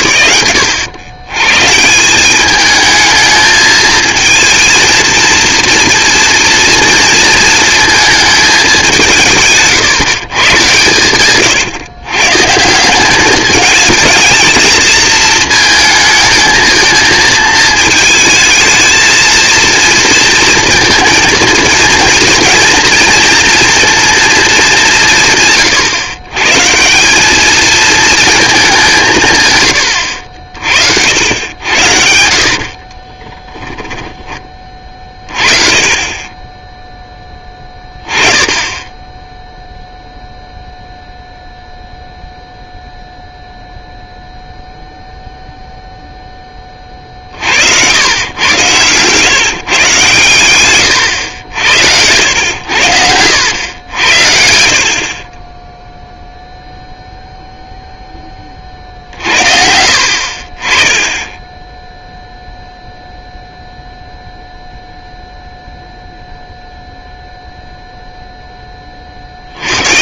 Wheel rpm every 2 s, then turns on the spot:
110, 220, 230, 230, 150, 130, 210, 230, 230, 230, 220, 230, 140, 210, 140, 80, 20, 40, 10, 10, 0, 0, 0, 20, 110, 120, 90, 60, 0, 20, 40, 0, 0, 0, 0.
30-34